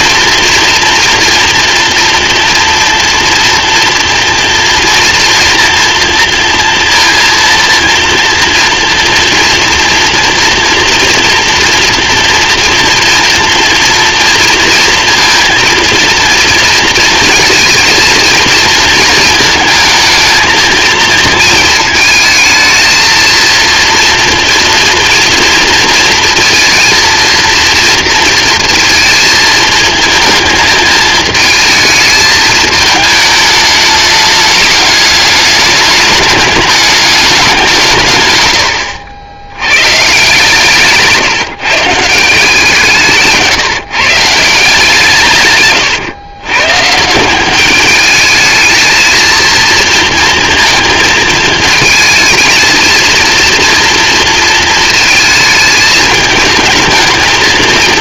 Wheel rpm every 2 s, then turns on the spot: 230, 230, 230, 230, 240, 230, 230, 230, 230, 220, 230, 230, 230, 230, 220, 210, 210, 210, 210, 90, 150, 170, 160, 130, 220, 220, 220, 230, 220.
38-40